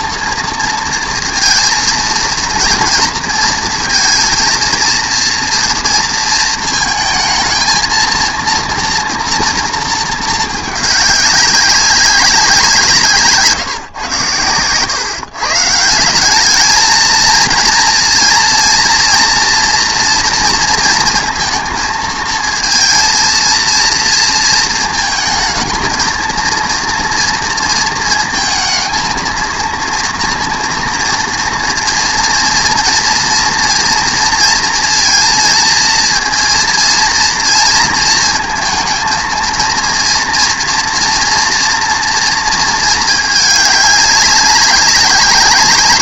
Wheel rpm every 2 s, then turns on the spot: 230, 230, 230, 220, 230, 220, 180, 100, 210, 230, 230, 220, 230, 230, 230, 230, 230, 230, 230, 230, 230, 230, 200.
none